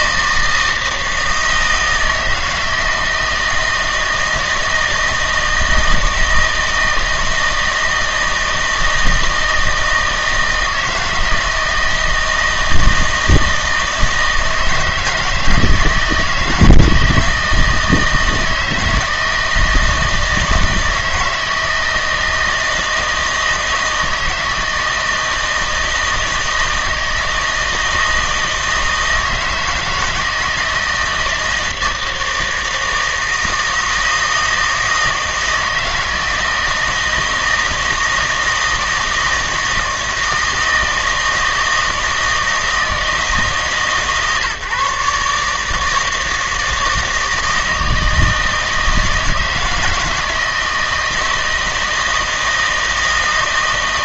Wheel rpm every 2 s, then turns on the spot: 160, 160, 160, 160, 160, 160, 160, 160, 170, 160, 160, 160, 160, 160, 160, 160, 160, 160, 160, 160, 160, 160, 140, 160, 160, 160, 160.
none